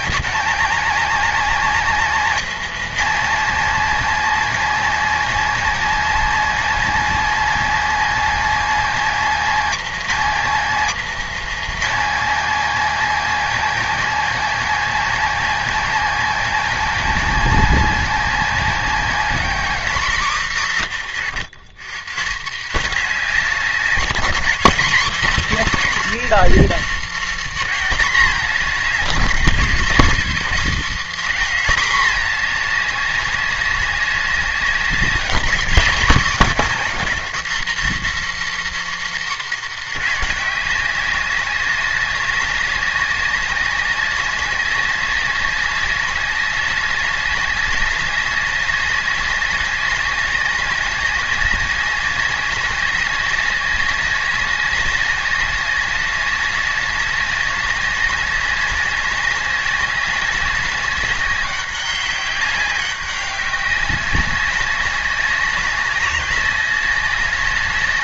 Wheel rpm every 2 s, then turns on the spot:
230, 230, 230, 230, 230, 240, 230, 230, 230, 230, 190, 180, 210, 270, 210, 260, 210, 200, 250, 280, 190, 200, 190, 190, 200, 190, 200, 190, 190, 200, 190, 200, 190, 190.
none